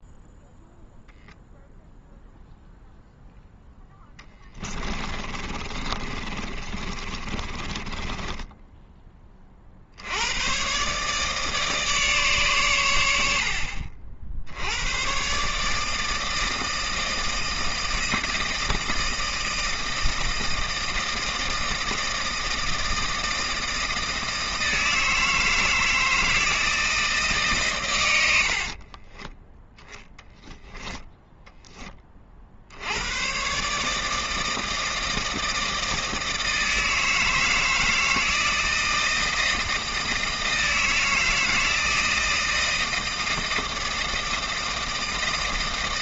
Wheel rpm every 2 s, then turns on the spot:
0, 0, 20, 30, 10, 130, 120, 90, 160, 160, 160, 160, 160, 160, 40, 0, 70, 160, 160, 160, 160, 160, 160.
4-8 28-30